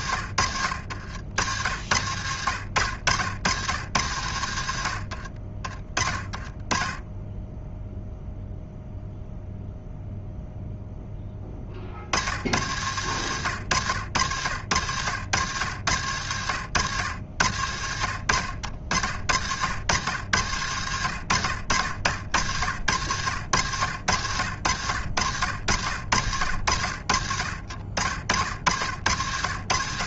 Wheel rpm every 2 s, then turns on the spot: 70, 80, 80, 20, 0, 0, 80, 70, 80, 70, 90, 60, 80, 70, 60.
none